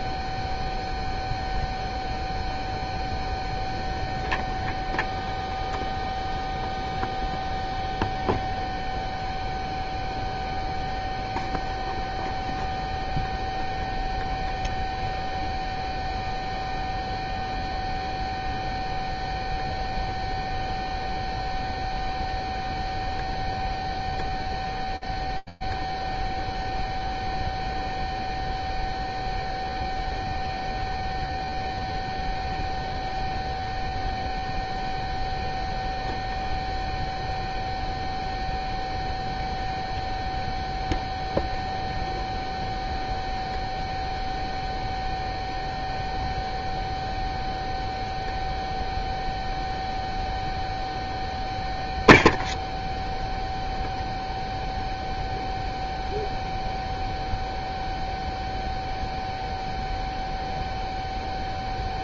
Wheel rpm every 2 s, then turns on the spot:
0, 0, 0, 0, 0, 0, 0, 0, 0, 0, 0, 0, 0, 0, 0, 0, 0, 0, 0, 0, 0, 0, 0, 0, 0, 0, 0, 0, 0, 0, 0.
none